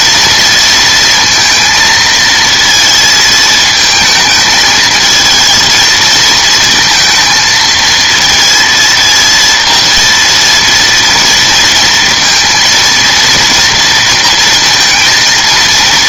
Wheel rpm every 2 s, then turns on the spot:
230, 220, 220, 230, 230, 230, 230, 230.
none